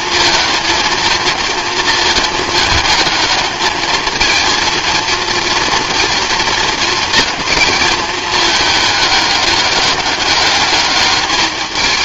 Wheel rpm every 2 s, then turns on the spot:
220, 220, 230, 230, 210, 200.
none